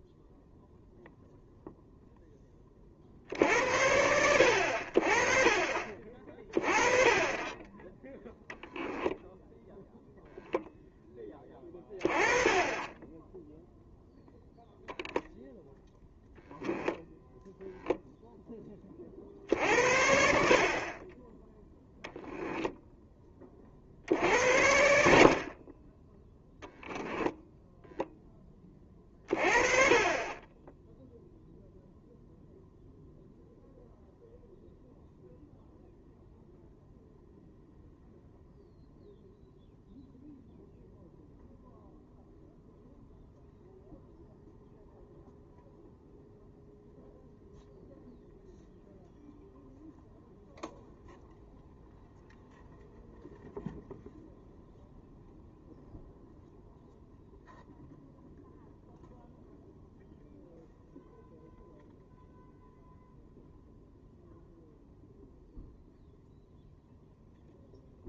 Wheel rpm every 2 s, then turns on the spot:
0, 50, 50, 30, 0, 10, 0, 0, 0, 60, 10, 40, 40, 0, 30, 0, 0, 0, 0, 0, 0, 0, 0, 0, 0, 0, 0, 0, 0, 0, 0, 0, 0, 0.
none